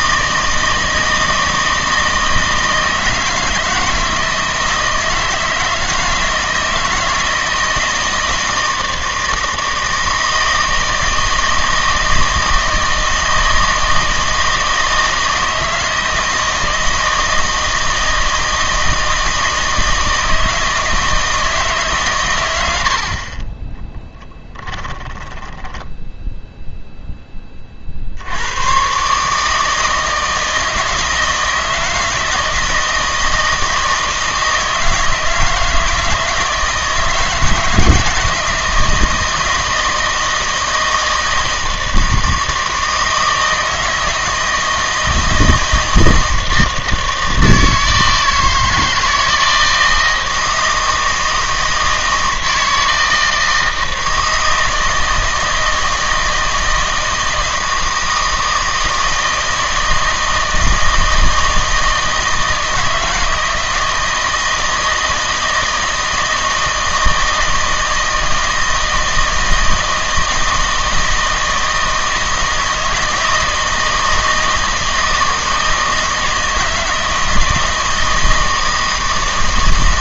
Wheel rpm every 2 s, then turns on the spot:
160, 160, 160, 160, 160, 160, 160, 160, 160, 160, 160, 90, 10, 0, 100, 160, 170, 160, 160, 160, 160, 160, 160, 160, 160, 160, 160, 160, 160, 160, 160, 160, 160, 160, 160, 160, 160, 160, 160, 160.
24-26